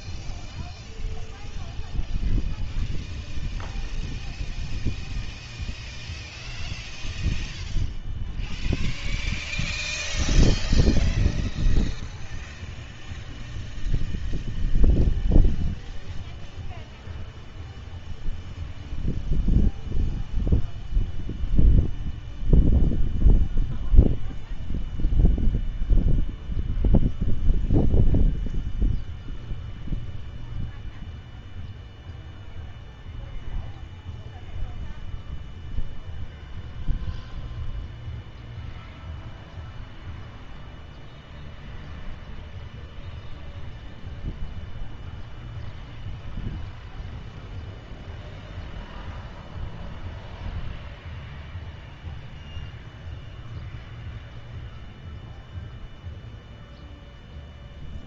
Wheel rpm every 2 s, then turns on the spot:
0, 0, 0, 0, 0, 0, 0, 0, 0, 0, 0, 0, 0, 0, 0, 0, 0, 0, 0, 0, 0, 0, 0, 0, 0, 0, 0, 0, 0.
none